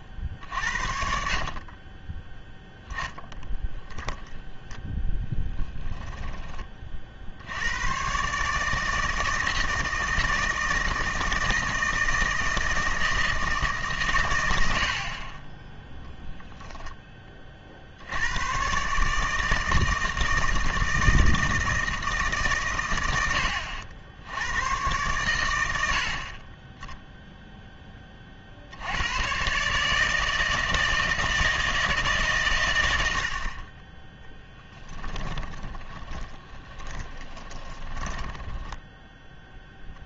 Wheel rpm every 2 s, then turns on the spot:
60, 10, 20, 30, 160, 160, 160, 80, 0, 130, 160, 120, 110, 10, 80, 160, 110, 10, 20, 10.
4-6 34-40